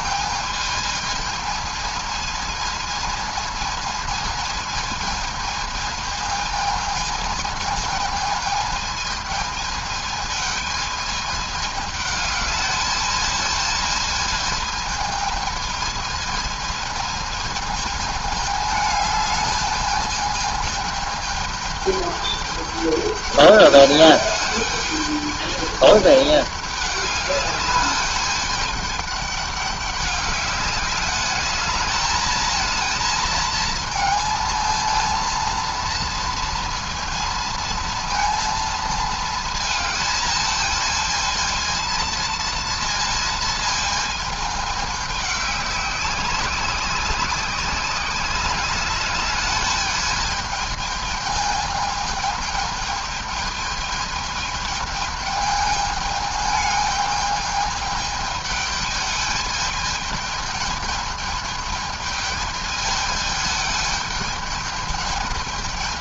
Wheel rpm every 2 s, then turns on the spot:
220, 220, 220, 220, 220, 220, 220, 220, 220, 220, 210, 210, 210, 210, 210, 200, 220, 230, 230, 230, 220, 230, 210, 190, 200, 210, 210, 210, 210, 210, 210, 210, 210.
none